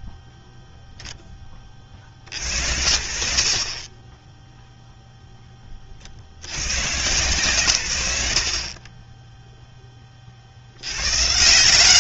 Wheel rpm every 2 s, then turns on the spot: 40, 0, 70, 40, 20, 180.
none